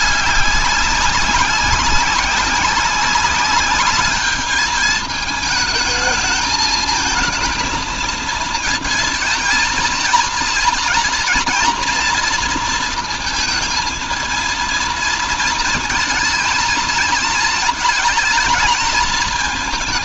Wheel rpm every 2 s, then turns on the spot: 200, 200, 220, 220, 220, 240, 230, 230, 220, 220.
none